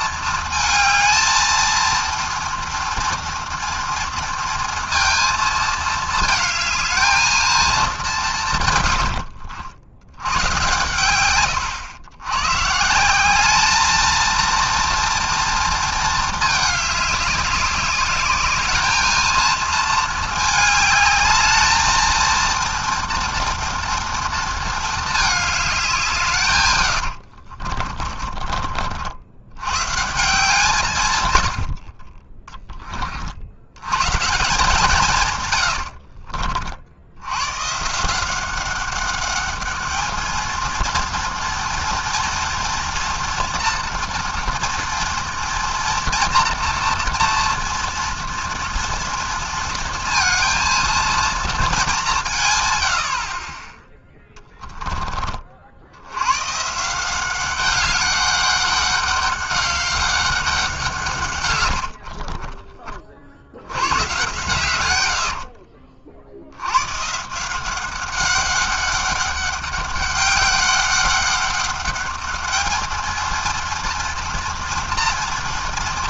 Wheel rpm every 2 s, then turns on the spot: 230, 230, 230, 220, 170, 110, 120, 230, 210, 210, 220, 230, 230, 130, 40, 160, 20, 160, 70, 200, 230, 230, 230, 230, 230, 230, 90, 30, 170, 200, 150, 60, 70, 150, 200, 200, 230, 230.
64-66